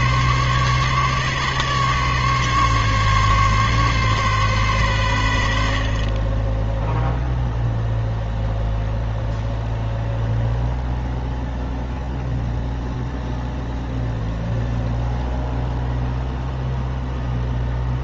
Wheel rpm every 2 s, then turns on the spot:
140, 140, 130, 10, 0, 0, 0, 0, 0.
none